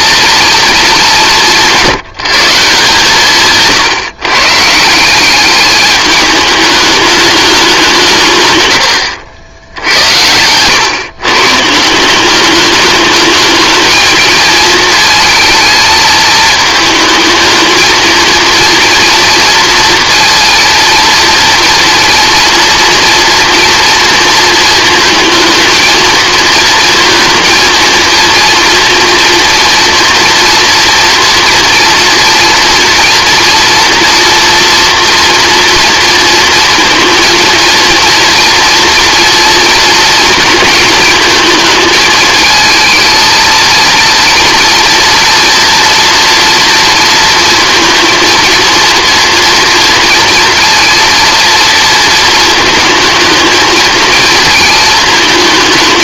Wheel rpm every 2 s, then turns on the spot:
210, 160, 170, 210, 110, 120, 210, 220, 220, 230, 230, 240, 230, 230, 230, 230, 230, 230, 230, 230, 220, 220, 240, 230, 230, 230, 220, 220.
none